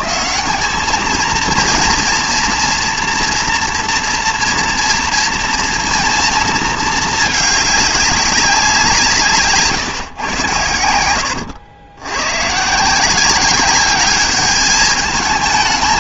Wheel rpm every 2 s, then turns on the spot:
210, 230, 230, 230, 200, 120, 130, 210.
none